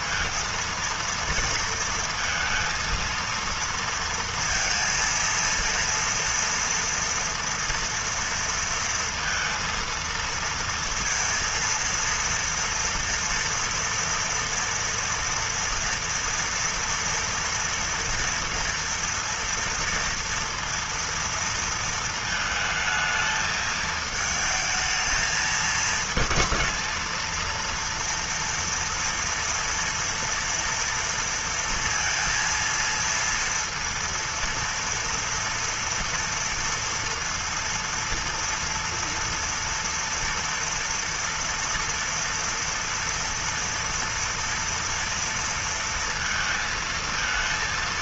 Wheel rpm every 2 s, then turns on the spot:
230, 230, 230, 230, 230, 230, 230, 230, 240, 230, 230, 220, 220, 220, 230, 230, 230, 230, 230, 230, 230, 230, 230, 220.
none